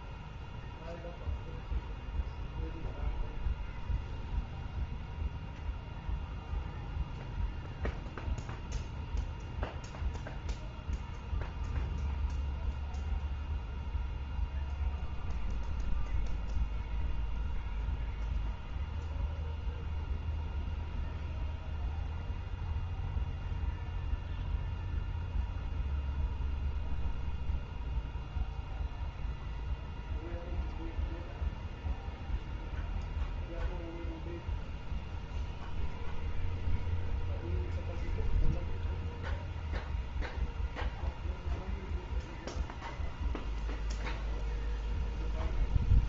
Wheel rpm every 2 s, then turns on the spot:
0, 0, 0, 0, 0, 0, 0, 0, 0, 0, 0, 0, 0, 0, 0, 0, 0, 0, 0, 0, 0, 0, 0.
none